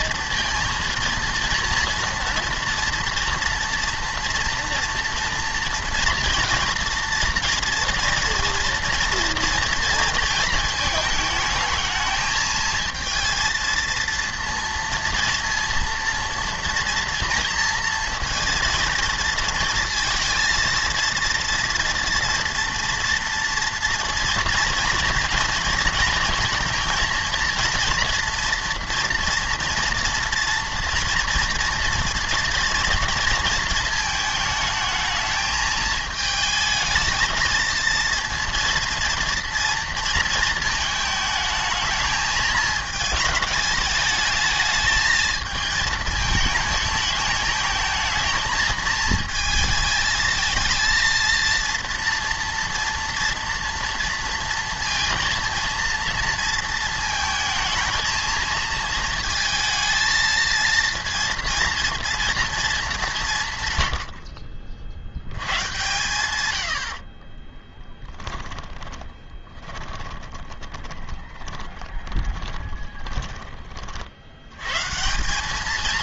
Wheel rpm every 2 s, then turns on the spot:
230, 230, 230, 230, 230, 220, 220, 230, 230, 230, 230, 240, 230, 230, 230, 230, 230, 220, 220, 230, 220, 220, 220, 220, 220, 220, 230, 230, 230, 230, 230, 220, 60, 90, 20, 20, 20, 120.
68-74